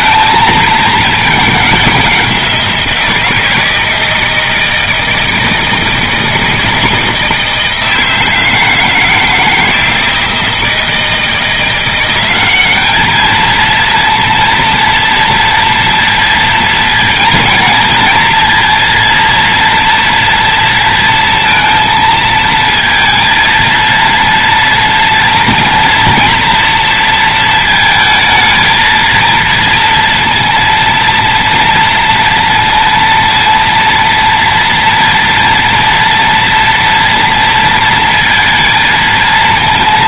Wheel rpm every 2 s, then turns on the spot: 210, 170, 160, 170, 160, 160, 210, 230, 230, 230, 230, 230, 230, 230, 220, 230, 230, 230, 230, 220.
none